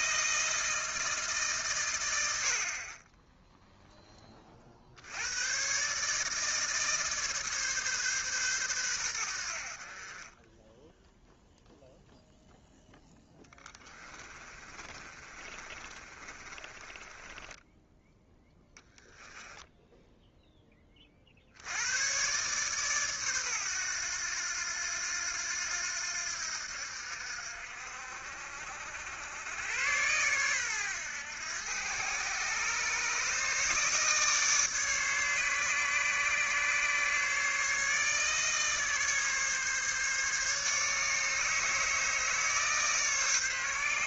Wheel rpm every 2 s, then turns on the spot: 160, 30, 70, 150, 100, 0, 0, 30, 20, 0, 30, 130, 90, 70, 80, 110, 140, 150, 150, 150, 150, 150.
14-18